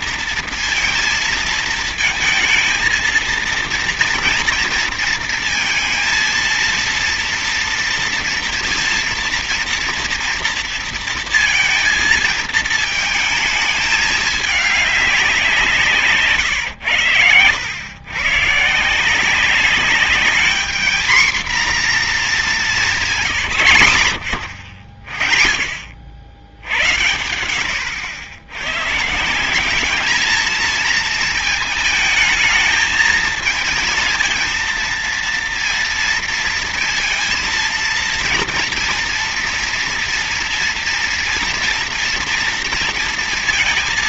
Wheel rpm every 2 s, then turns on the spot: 230, 220, 230, 230, 230, 230, 220, 210, 140, 130, 220, 220, 100, 90, 120, 220, 220, 230, 230, 240, 240, 230.
none